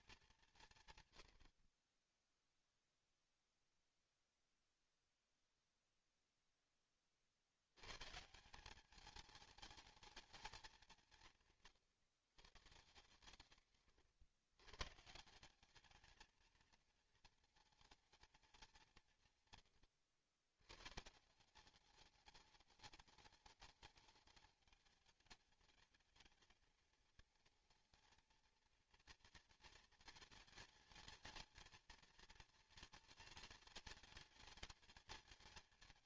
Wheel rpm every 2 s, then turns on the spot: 140, 0, 0, 10, 190, 210, 150, 130, 230, 190, 120, 210, 200, 220, 230, 220, 230, 210.
none